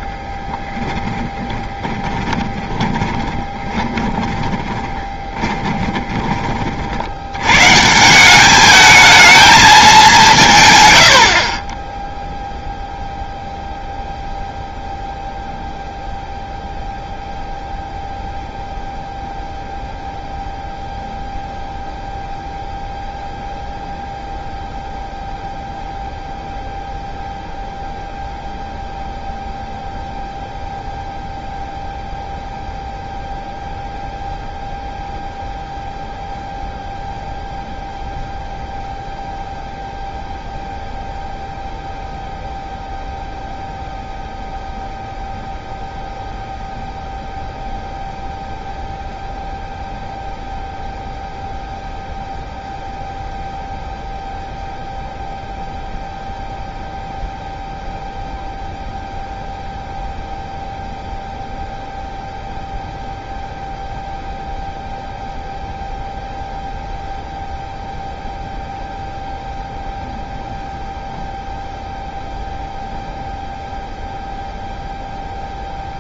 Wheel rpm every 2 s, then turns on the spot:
10, 20, 20, 30, 200, 130, 0, 0, 0, 0, 0, 0, 0, 0, 0, 0, 0, 0, 0, 0, 0, 0, 0, 0, 0, 0, 0, 0, 0, 0, 0, 0, 0, 0, 0, 0, 0, 0.
0-6